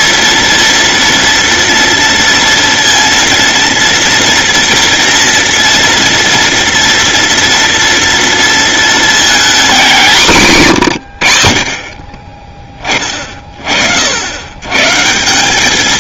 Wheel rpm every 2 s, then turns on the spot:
230, 230, 230, 230, 230, 170, 30, 130.
none